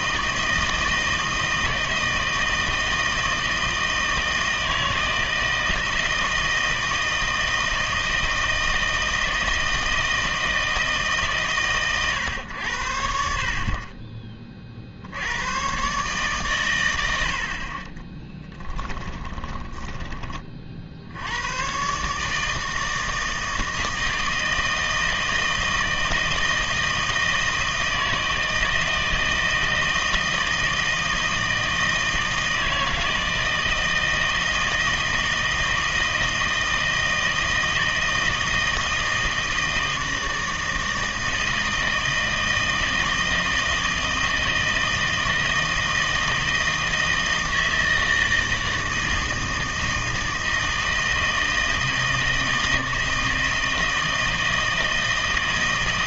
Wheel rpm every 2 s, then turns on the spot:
160, 160, 160, 160, 160, 160, 90, 30, 120, 10, 50, 160, 160, 160, 160, 160, 160, 160, 160, 160, 160, 160, 160, 160, 160, 160, 160, 160.
18-20